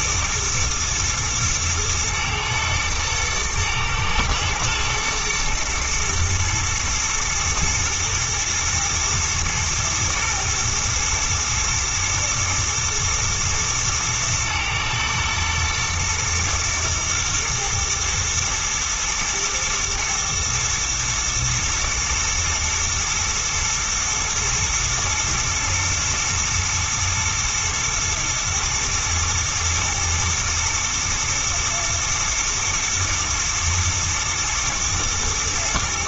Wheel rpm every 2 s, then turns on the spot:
110, 110, 110, 110, 120, 120, 110, 120, 110, 110, 110, 110, 110, 120, 110, 110, 110, 120.
none